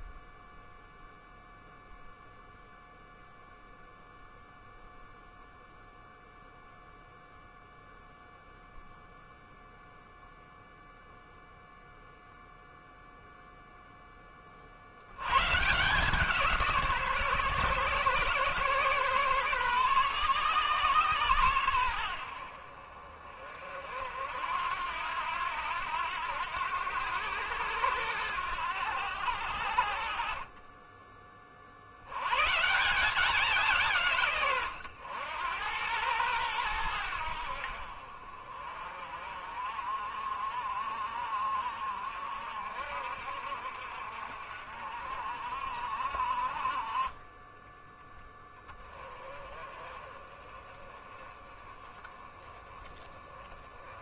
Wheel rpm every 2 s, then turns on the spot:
0, 0, 0, 0, 0, 0, 0, 60, 150, 130, 130, 50, 80, 90, 90, 30, 150, 100, 100, 40, 50, 60, 50, 30, 20, 20, 20.
30-32